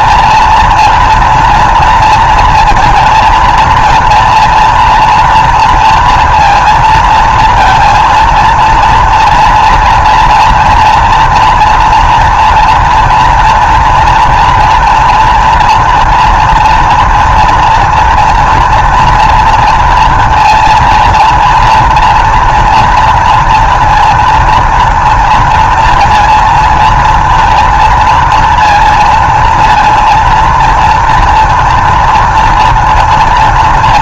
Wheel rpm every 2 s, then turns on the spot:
230, 230, 230, 230, 230, 230, 230, 230, 240, 230, 230, 230, 230, 230, 230, 230, 230.
none